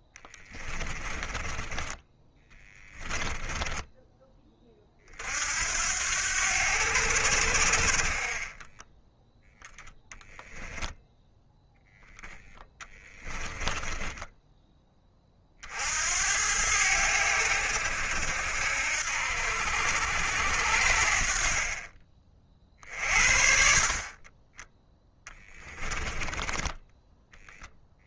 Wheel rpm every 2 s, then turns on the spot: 20, 20, 40, 90, 10, 0, 10, 20, 90, 70, 70, 50, 10, 10.
0-4 8-10 12-14 26-28